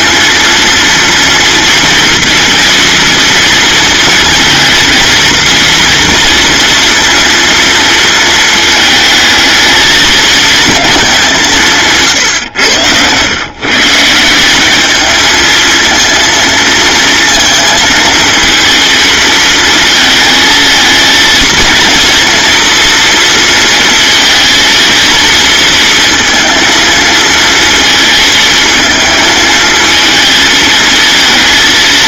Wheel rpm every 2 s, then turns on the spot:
240, 230, 230, 230, 220, 200, 120, 220, 230, 220, 230, 230, 230, 230, 220, 230.
none